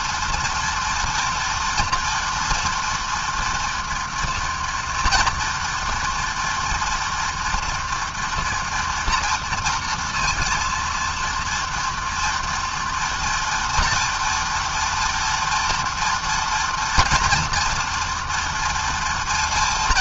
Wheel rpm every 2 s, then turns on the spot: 230, 230, 230, 240, 230, 230, 230, 230, 240, 230.
none